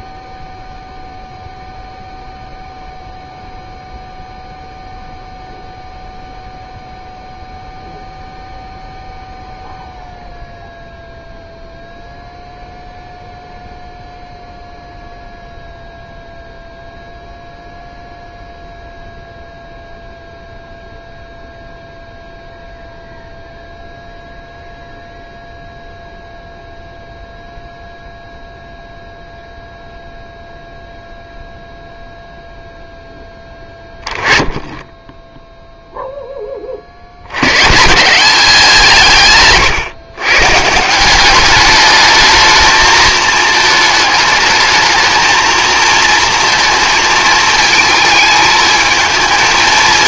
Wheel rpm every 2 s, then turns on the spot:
0, 0, 0, 0, 0, 0, 0, 0, 0, 0, 0, 0, 0, 0, 0, 0, 0, 10, 30, 180, 150, 220, 220, 230, 220.
none